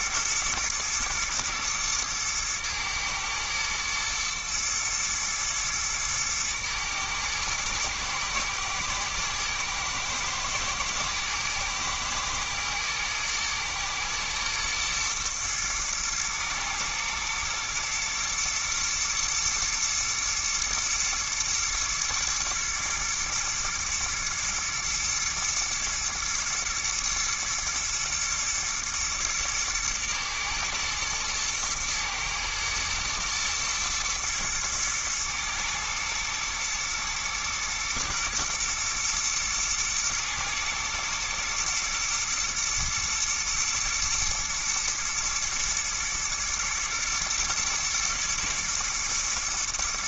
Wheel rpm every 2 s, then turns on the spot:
120, 110, 120, 110, 110, 120, 120, 120, 110, 120, 120, 120, 120, 110, 110, 110, 110, 110, 110, 120, 110, 110, 110, 110, 110.
none